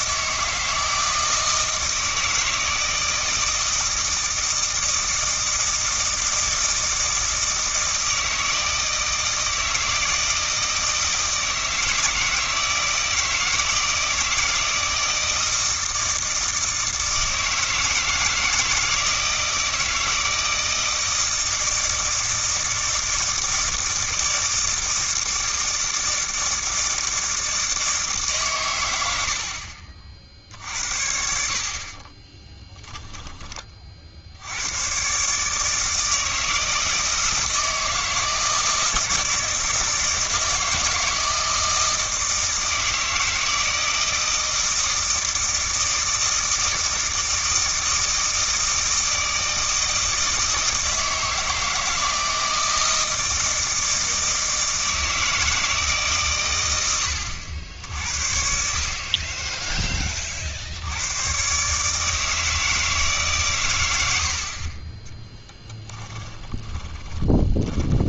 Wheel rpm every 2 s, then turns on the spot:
160, 160, 160, 160, 160, 160, 160, 160, 160, 160, 160, 160, 160, 160, 100, 70, 10, 110, 160, 160, 160, 160, 160, 160, 160, 160, 160, 160, 100, 50, 70, 160, 30, 20.
32-34 66-68